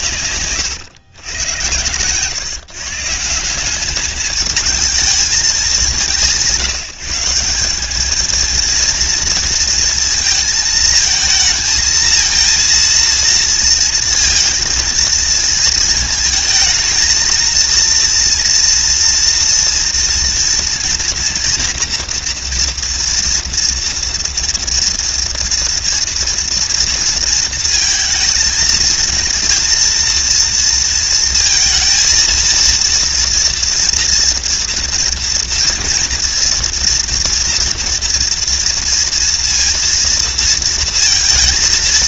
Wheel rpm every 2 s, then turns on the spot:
110, 160, 210, 180, 230, 220, 230, 230, 230, 230, 230, 240, 230, 230, 230, 230, 230, 230, 230, 230, 230.
none